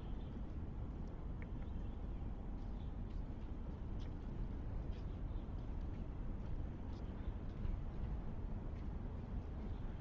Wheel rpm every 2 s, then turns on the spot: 0, 0, 0, 0, 0.
none